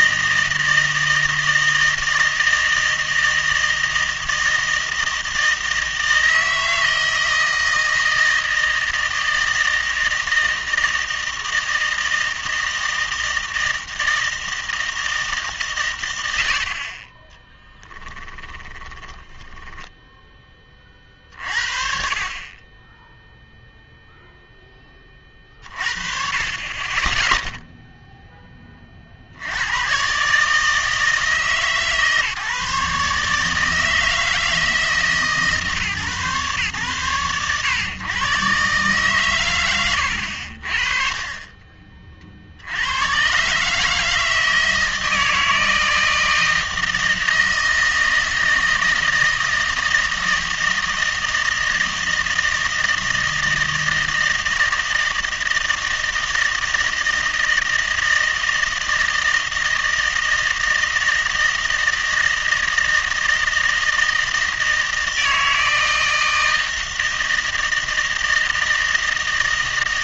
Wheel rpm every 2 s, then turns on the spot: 160, 160, 160, 160, 160, 160, 160, 160, 70, 30, 20, 20, 10, 30, 20, 160, 150, 160, 110, 130, 40, 80, 160, 160, 160, 160, 160, 160, 160, 160, 160, 160, 160, 160, 160.
18-20